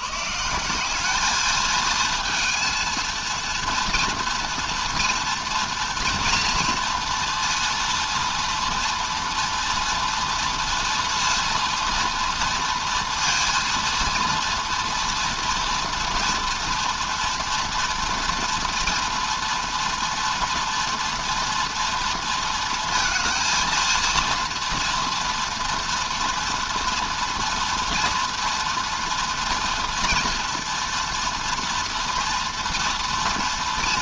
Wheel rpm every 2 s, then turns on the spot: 180, 230, 240, 230, 230, 230, 230, 230, 230, 230, 240, 230, 230, 240, 230, 230, 230.
none